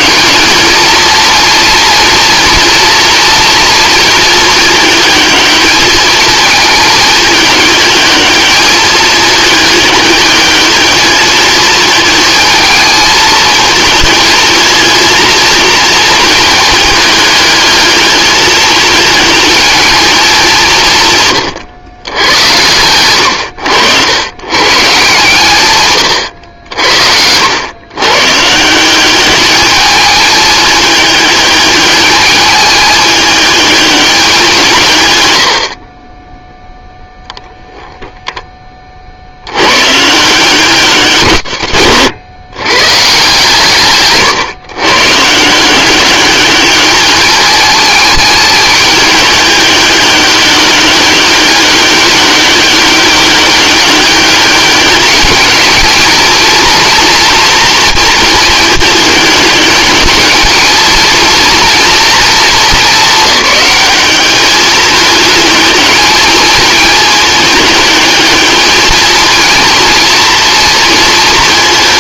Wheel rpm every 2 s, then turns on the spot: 230, 230, 220, 220, 210, 220, 220, 230, 210, 220, 170, 110, 130, 70, 180, 210, 210, 140, 0, 40, 150, 130, 120, 200, 210, 200, 200, 210, 230, 210, 220, 220, 210, 210, 220, 230.
none